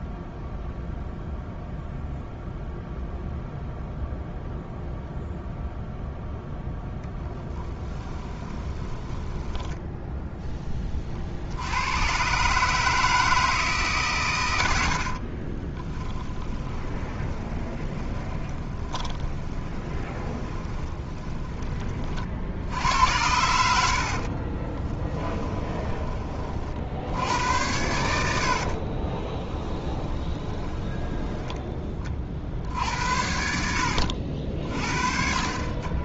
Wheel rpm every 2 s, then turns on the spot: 0, 0, 0, 0, 20, 20, 150, 80, 20, 20, 20, 80, 30, 50, 60, 10, 60, 50.
8-10 16-22 24-26 28-32